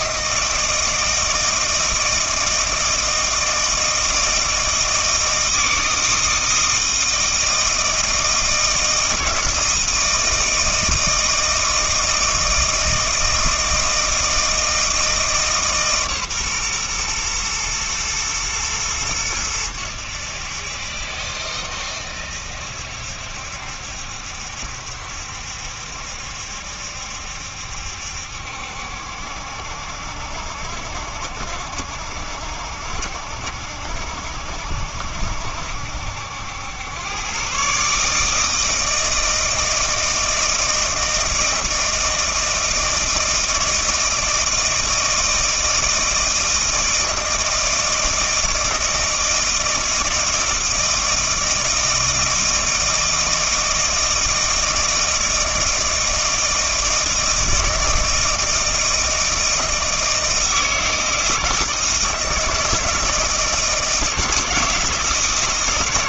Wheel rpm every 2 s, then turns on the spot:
160, 160, 160, 160, 160, 160, 160, 160, 120, 110, 70, 70, 70, 70, 70, 70, 60, 70, 100, 160, 160, 160, 160, 160, 160, 160, 160, 160, 160, 160, 160, 160, 160.
none